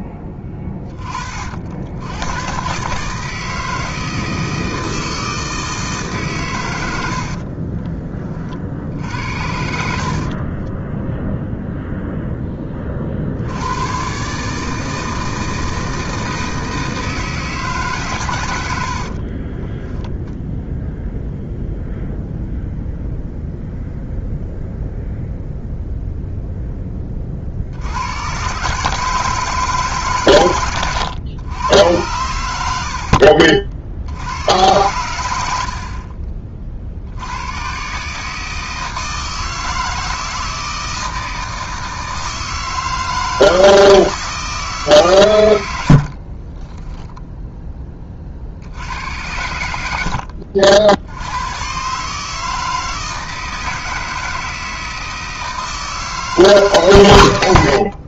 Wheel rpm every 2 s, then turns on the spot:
10, 130, 160, 110, 60, 20, 20, 160, 160, 90, 0, 0, 0, 10, 140, 120, 90, 100, 50, 160, 160, 160, 150, 10, 70, 70, 160, 160, 150.
10-12 18-20 46-48